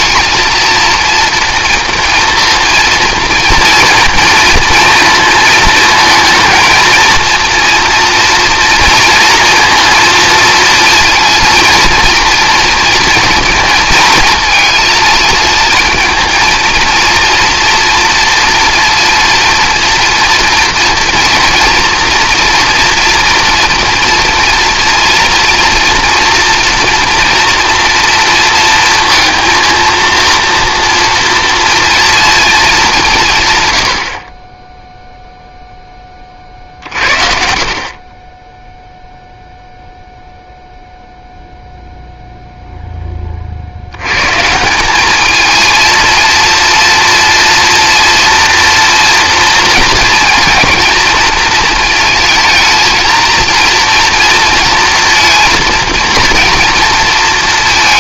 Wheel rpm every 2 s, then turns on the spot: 230, 230, 230, 230, 230, 230, 230, 220, 230, 230, 230, 230, 230, 230, 230, 230, 200, 10, 50, 0, 0, 0, 190, 230, 240, 230, 230, 230, 230.
none